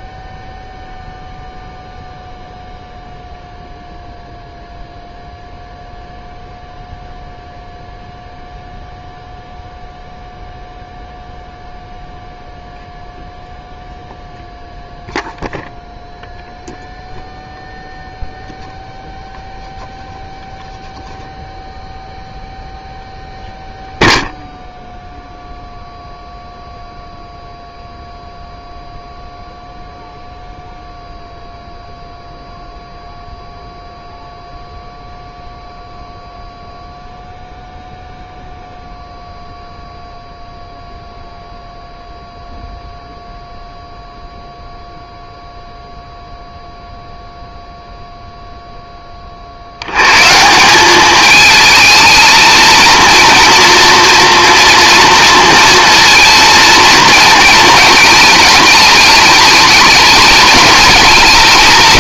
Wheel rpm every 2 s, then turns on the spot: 0, 0, 0, 0, 0, 0, 0, 0, 0, 0, 0, 0, 0, 0, 0, 0, 0, 0, 0, 0, 0, 0, 0, 0, 0, 170, 230, 240, 230, 220, 210.
none